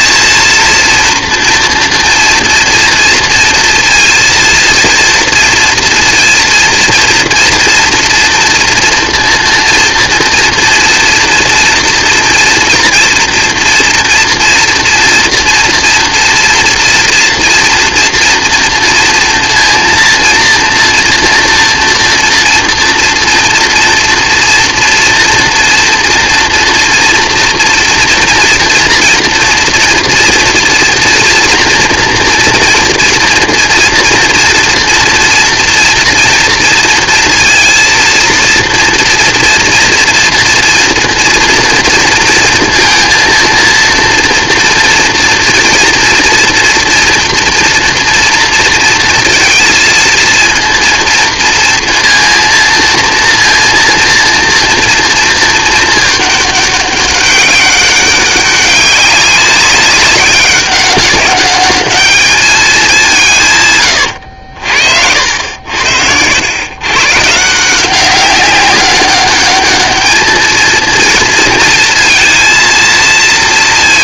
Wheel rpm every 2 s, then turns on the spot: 230, 230, 230, 230, 230, 230, 240, 230, 230, 230, 230, 230, 230, 240, 240, 240, 230, 230, 230, 230, 230, 230, 230, 230, 230, 230, 230, 230, 200, 190, 190, 200, 60, 120, 200, 230, 230.
none